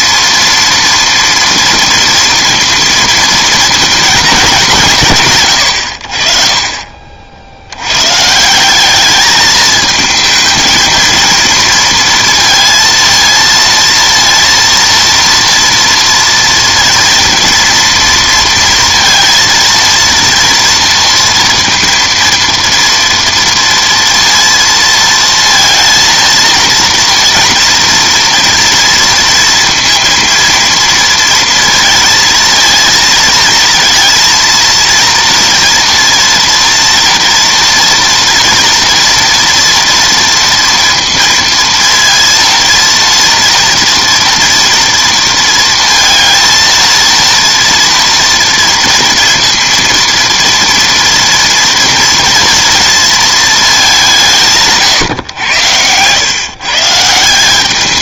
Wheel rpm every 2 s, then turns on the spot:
230, 230, 180, 40, 190, 220, 230, 230, 230, 230, 230, 230, 230, 230, 230, 230, 230, 230, 240, 240, 230, 230, 230, 230, 230, 230, 230, 150, 150.
none